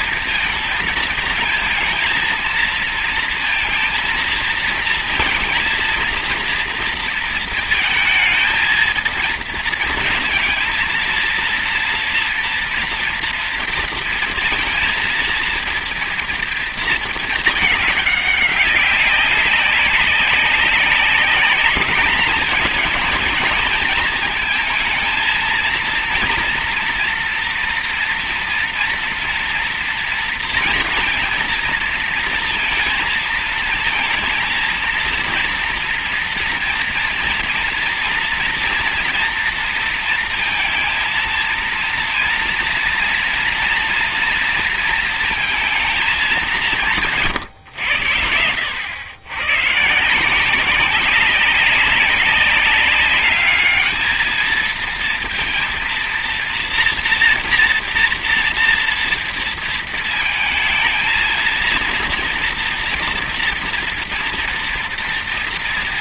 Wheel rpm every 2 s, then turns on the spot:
230, 230, 230, 230, 220, 230, 230, 230, 230, 190, 200, 220, 220, 240, 230, 230, 220, 230, 230, 230, 230, 230, 230, 170, 100, 190, 210, 230, 230, 230, 230, 230, 230.
none